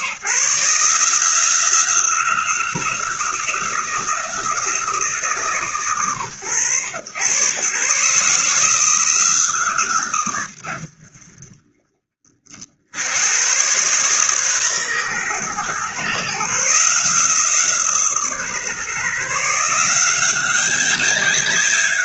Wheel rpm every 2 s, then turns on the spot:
150, 180, 170, 110, 160, 90, 70, 130, 150, 150, 200.
none